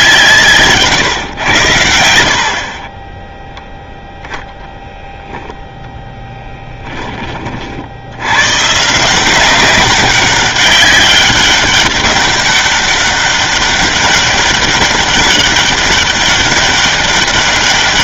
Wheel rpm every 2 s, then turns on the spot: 150, 40, 0, 10, 150, 190, 200, 200, 200.
none